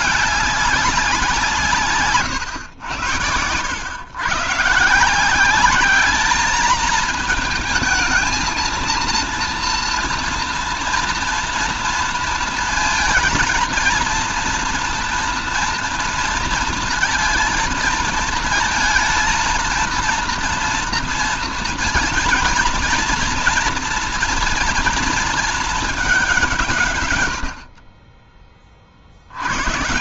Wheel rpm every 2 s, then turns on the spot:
210, 120, 140, 220, 230, 230, 230, 230, 230, 230, 230, 230, 230, 180, 40.
none